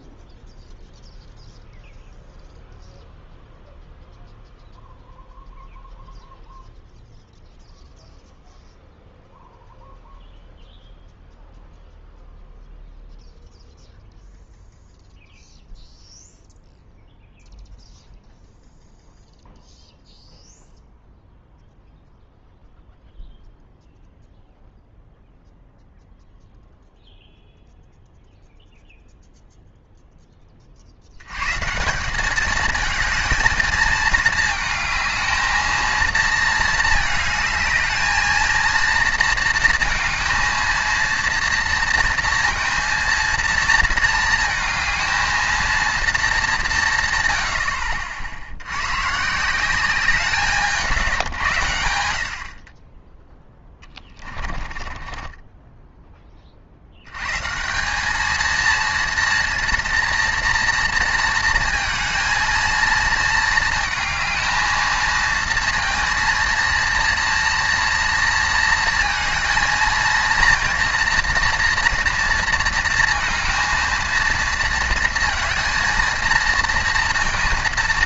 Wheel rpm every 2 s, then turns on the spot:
0, 0, 0, 0, 0, 0, 0, 0, 0, 0, 0, 0, 0, 0, 0, 20, 200, 220, 220, 220, 230, 230, 220, 200, 80, 170, 60, 20, 40, 220, 230, 230, 220, 230, 230, 230, 230, 230, 230.
54-56